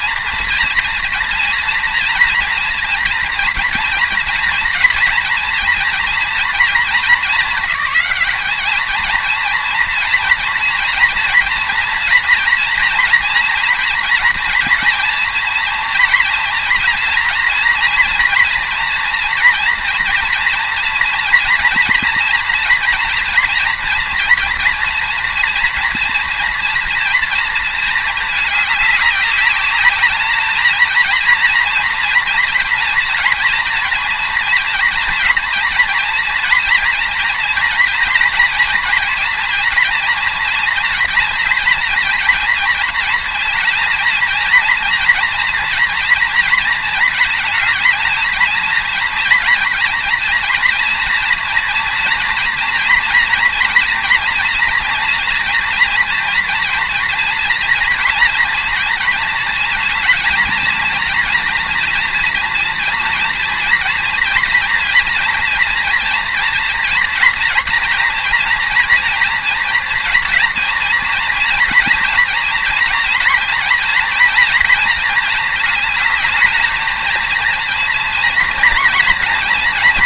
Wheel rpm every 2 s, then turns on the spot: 240, 230, 230, 220, 210, 240, 230, 230, 230, 230, 230, 230, 240, 230, 210, 220, 230, 230, 240, 230, 230, 230, 230, 230, 230, 230, 230, 230, 230, 230, 230, 230, 230, 240, 230, 240, 230, 230, 220, 230.
none